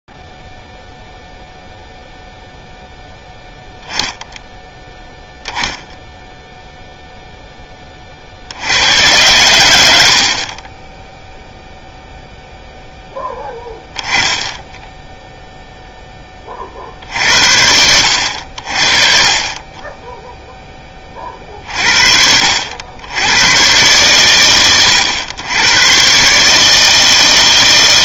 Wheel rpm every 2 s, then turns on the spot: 0, 0, 0, 0, 70, 30, 0, 10, 50, 50, 10, 70, 110, 150.
none